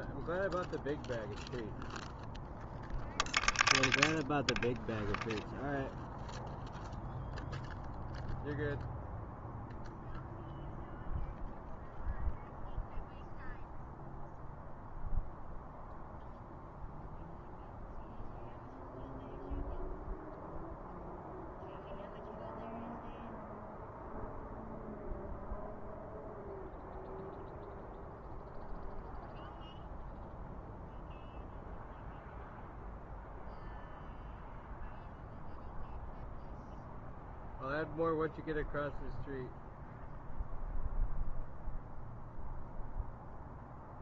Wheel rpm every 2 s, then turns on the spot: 0, 0, 0, 0, 0, 0, 0, 0, 0, 0, 0, 0, 0, 0, 0, 0, 0, 0, 0, 0, 0, 0.
none